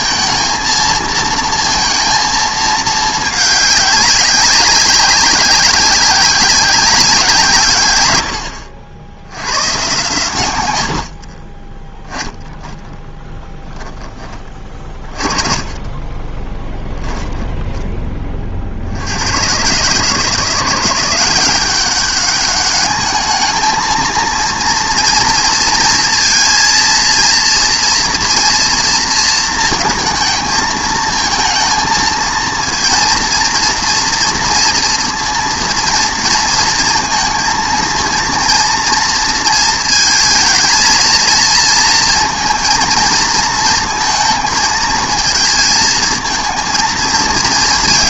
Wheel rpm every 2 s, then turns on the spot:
220, 220, 190, 190, 70, 90, 10, 40, 10, 60, 180, 210, 230, 230, 230, 220, 230, 230, 230, 230, 220, 220, 220, 230.
12-14 16-18